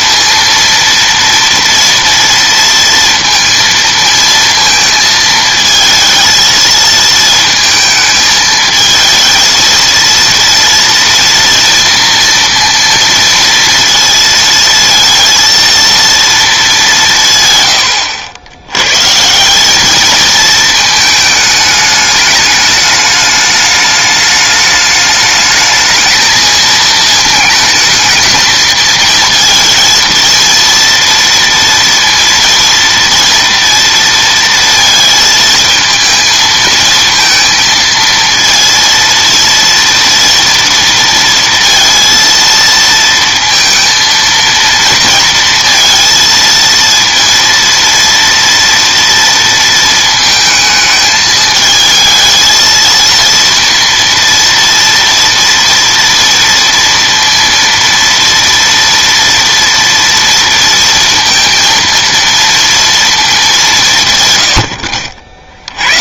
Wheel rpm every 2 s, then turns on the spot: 230, 230, 220, 220, 220, 230, 230, 230, 160, 140, 220, 210, 210, 220, 220, 230, 230, 230, 220, 230, 230, 230, 230, 230, 230, 220, 230, 230, 230, 230, 230, 220, 50.
none